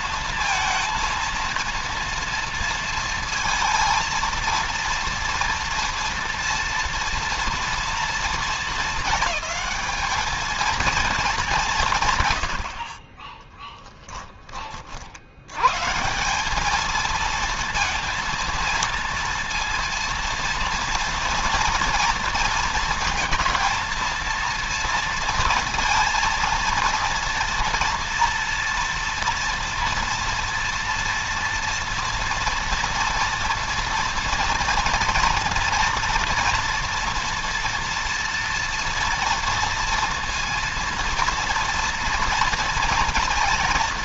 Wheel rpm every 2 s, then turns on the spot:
230, 230, 230, 230, 220, 220, 30, 60, 220, 230, 230, 220, 230, 230, 230, 230, 230, 230, 230, 230, 230, 230.
none